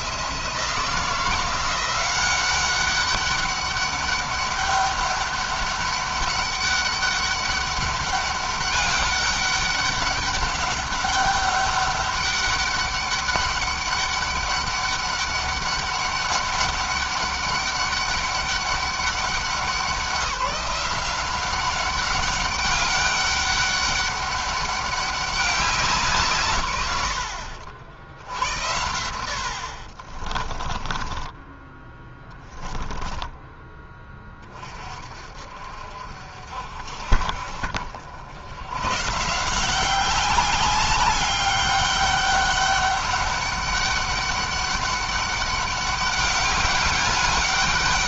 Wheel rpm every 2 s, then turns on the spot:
170, 190, 200, 200, 200, 200, 200, 200, 200, 200, 180, 200, 200, 140, 70, 20, 20, 30, 50, 120, 200, 200, 200, 200.
30-34